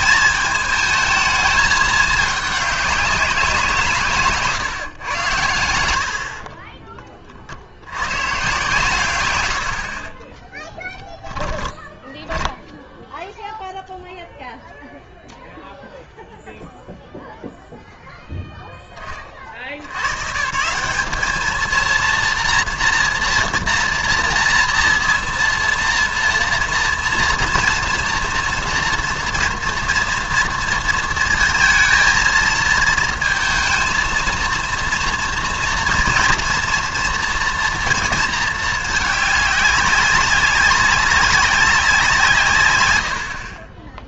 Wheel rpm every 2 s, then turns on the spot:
220, 210, 150, 30, 130, 10, 10, 0, 0, 0, 160, 240, 230, 230, 230, 230, 230, 230, 230, 220, 190, 110.
6-8 10-12